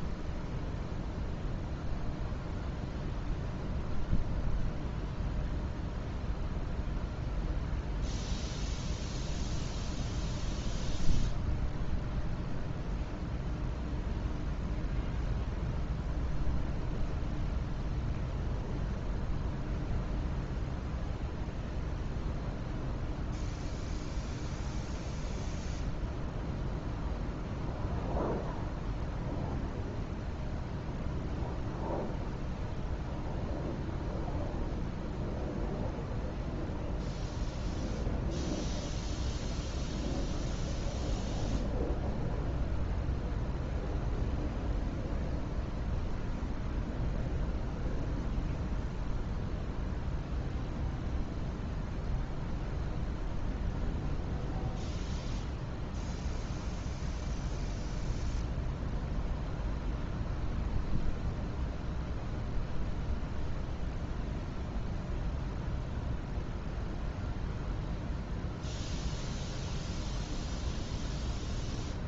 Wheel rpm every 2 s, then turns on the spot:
0, 0, 0, 0, 0, 0, 0, 0, 0, 0, 0, 0, 0, 0, 0, 0, 0, 0, 0, 0, 0, 0, 0, 0, 0, 0, 0, 0, 0, 0, 0, 0, 0, 0, 0, 0.
none